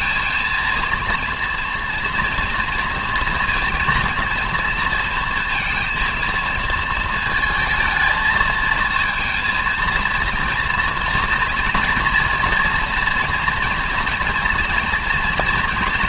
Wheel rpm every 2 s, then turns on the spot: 230, 230, 230, 230, 220, 230, 230, 230.
none